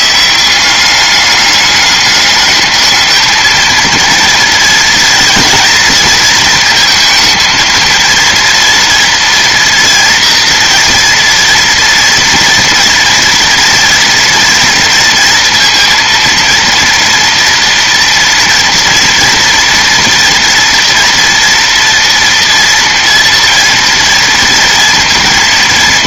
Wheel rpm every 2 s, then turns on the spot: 190, 210, 230, 220, 230, 230, 230, 230, 230, 230, 230, 230, 230.
none